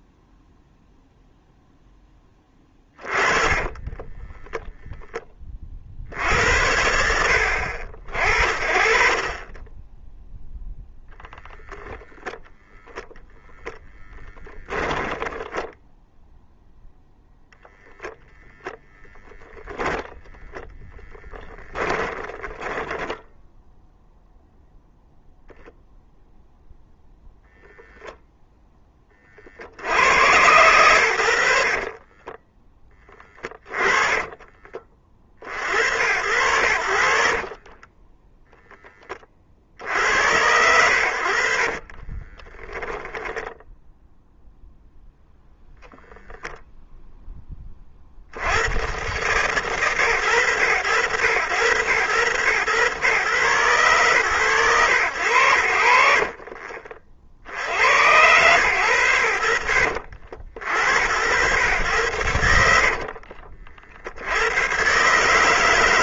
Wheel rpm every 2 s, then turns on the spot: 0, 10, 10, 60, 40, 0, 0, 10, 0, 10, 0, 10, 0, 0, 0, 100, 20, 30, 90, 0, 80, 20, 0, 0, 70, 100, 110, 120, 40, 120, 60, 90, 90.
14-16 22-24 32-34 42-44